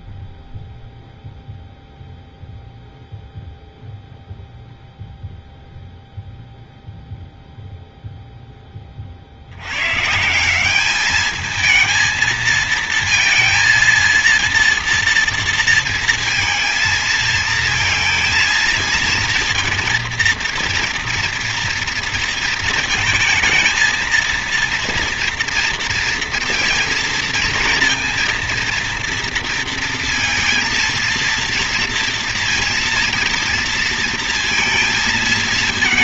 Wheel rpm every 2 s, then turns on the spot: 0, 0, 0, 0, 0, 170, 230, 230, 230, 230, 230, 230, 230, 230, 230, 230, 230, 230.
none